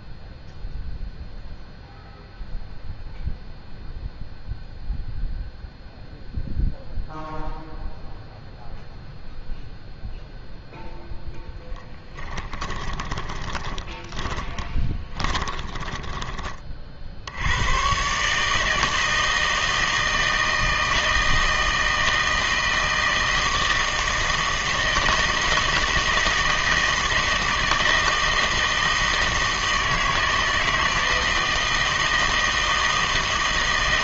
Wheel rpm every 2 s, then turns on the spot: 0, 0, 0, 0, 0, 0, 10, 10, 20, 150, 160, 160, 160, 160, 160, 160, 160.
12-16